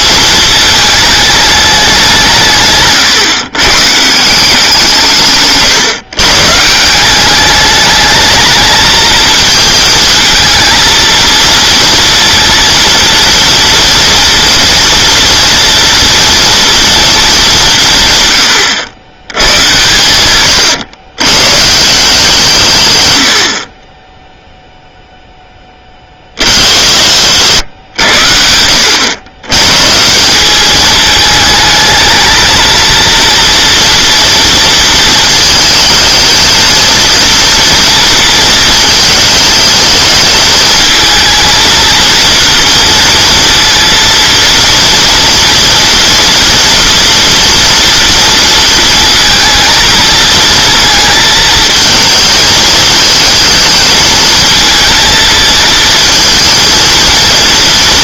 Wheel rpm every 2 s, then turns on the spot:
220, 140, 180, 160, 220, 220, 230, 230, 230, 90, 110, 140, 0, 50, 80, 210, 230, 230, 230, 230, 220, 230, 230, 230, 230, 220, 220, 230, 230.
2-4